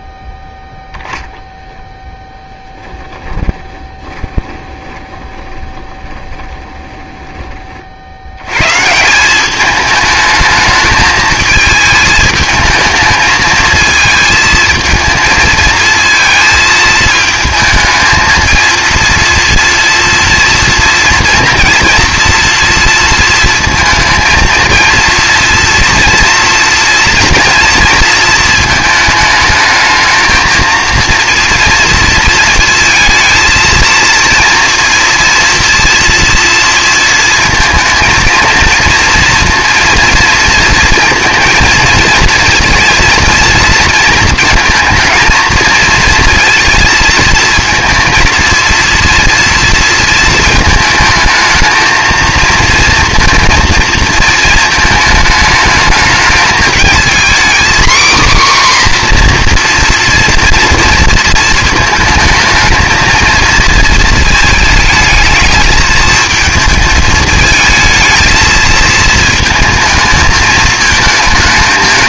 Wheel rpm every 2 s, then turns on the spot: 0, 10, 20, 20, 150, 220, 220, 220, 220, 230, 230, 230, 230, 230, 220, 230, 230, 230, 230, 230, 230, 230, 230, 230, 230, 220, 230, 220, 230, 260, 230, 220, 220, 220, 220, 220.
2-8